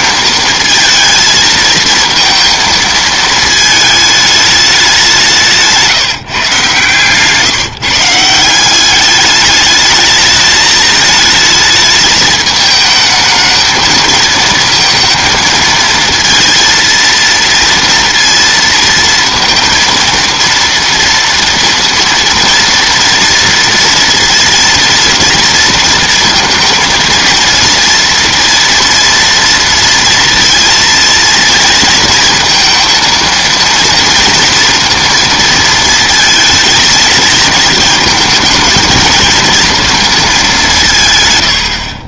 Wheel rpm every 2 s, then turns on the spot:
220, 220, 200, 140, 190, 210, 220, 230, 230, 230, 230, 230, 230, 230, 230, 230, 230, 230, 230, 230, 190.
none